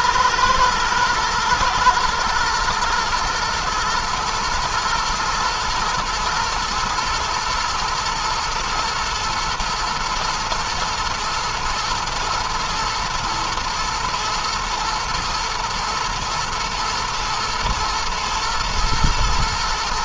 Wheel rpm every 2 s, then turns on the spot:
110, 120, 110, 120, 110, 120, 120, 120, 110, 120.
none